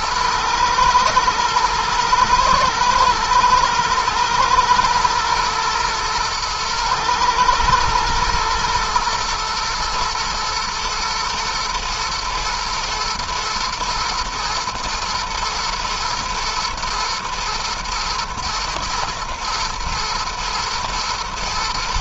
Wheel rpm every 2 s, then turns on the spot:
110, 110, 110, 110, 110, 120, 120, 110, 120, 110, 120.
none